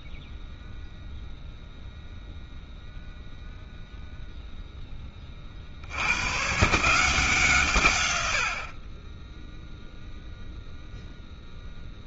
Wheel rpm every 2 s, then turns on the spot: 0, 0, 0, 140, 60, 0.
none